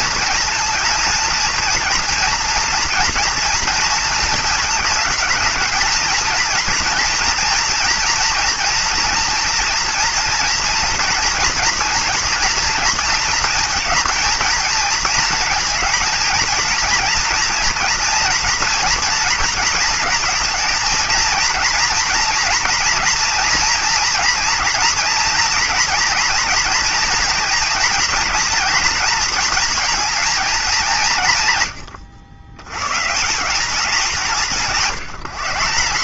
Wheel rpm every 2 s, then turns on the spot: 230, 230, 220, 230, 230, 240, 230, 230, 230, 240, 230, 230, 230, 240, 230, 210, 100, 180.
none